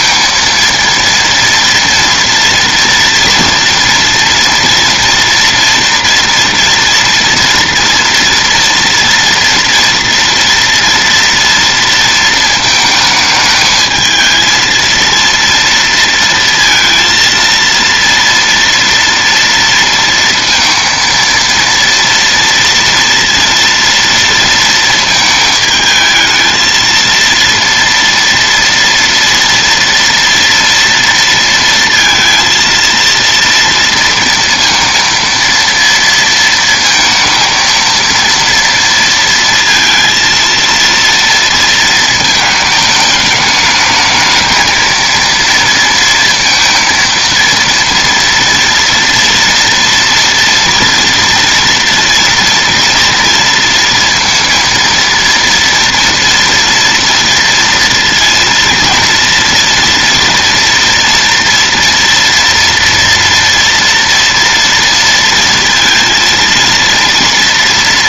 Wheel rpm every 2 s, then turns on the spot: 230, 230, 230, 230, 230, 230, 230, 220, 230, 230, 230, 230, 230, 220, 230, 230, 230, 230, 230, 230, 230, 220, 220, 230, 230, 230, 230, 230, 230, 230, 230, 230, 230, 230.
none